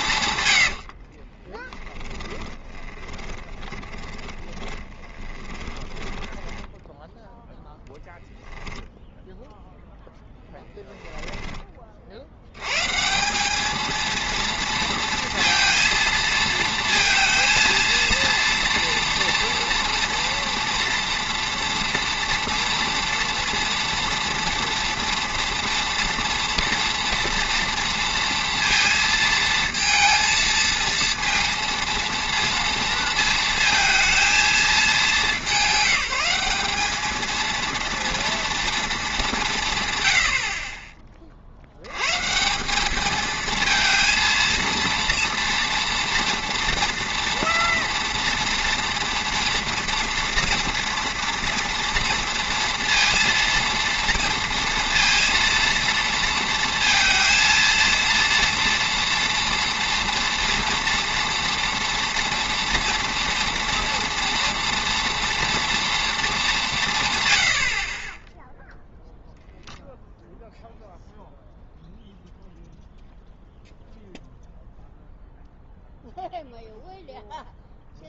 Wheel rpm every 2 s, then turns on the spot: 90, 20, 20, 10, 0, 10, 110, 230, 230, 230, 230, 230, 230, 230, 230, 230, 230, 220, 200, 230, 40, 190, 230, 230, 230, 230, 230, 230, 230, 230, 240, 230, 240, 180, 0, 0, 0, 0, 0.
0-8 10-12